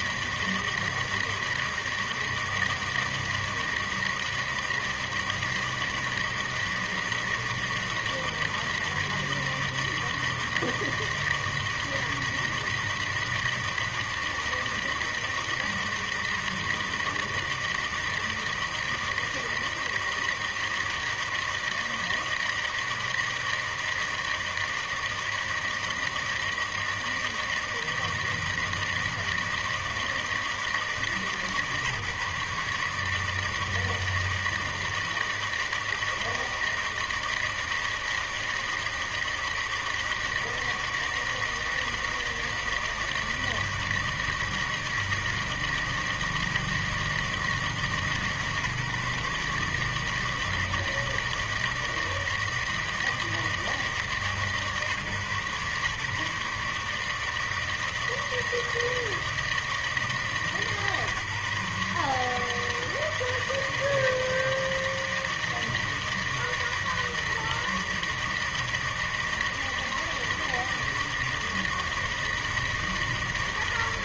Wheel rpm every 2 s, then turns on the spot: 160, 160, 160, 160, 160, 160, 160, 160, 160, 160, 160, 160, 160, 160, 160, 160, 140, 160, 160, 160, 160, 160, 160, 160, 150, 160, 160, 150, 140, 160, 160, 150, 160, 160, 160, 160, 160.
none